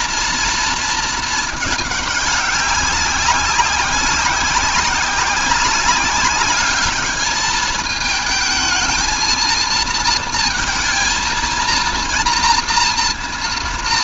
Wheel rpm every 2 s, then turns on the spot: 230, 200, 190, 210, 220, 230, 230.
none